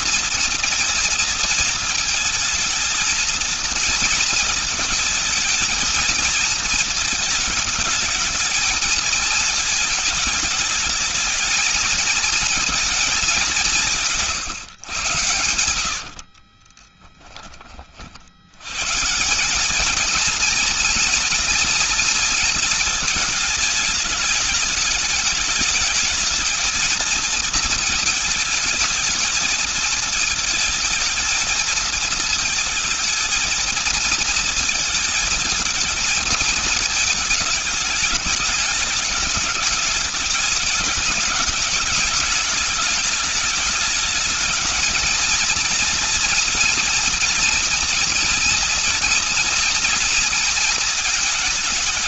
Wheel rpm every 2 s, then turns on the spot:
230, 220, 230, 230, 220, 210, 220, 150, 40, 110, 230, 230, 210, 220, 220, 220, 230, 230, 220, 210, 200, 210, 220, 240, 230, 230.
16-18